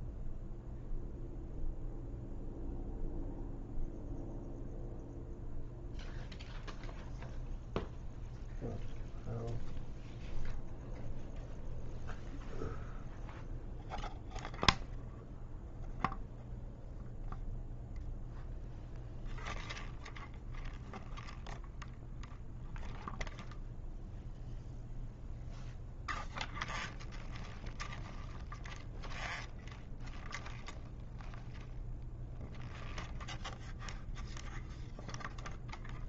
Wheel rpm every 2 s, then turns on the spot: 0, 0, 0, 0, 0, 0, 0, 0, 0, 0, 0, 0, 0, 0, 0, 0, 0, 0.
none